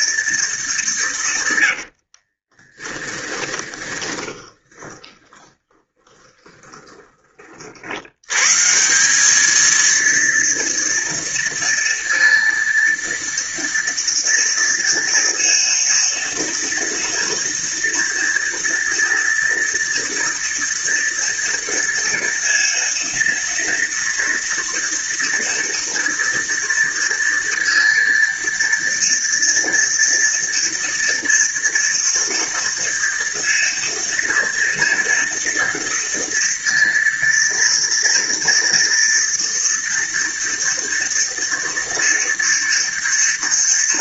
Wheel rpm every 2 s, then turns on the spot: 190, 20, 20, 20, 180, 230, 230, 230, 230, 230, 230, 230, 230, 230, 230, 230, 230, 230, 230, 230, 230, 230.
2-6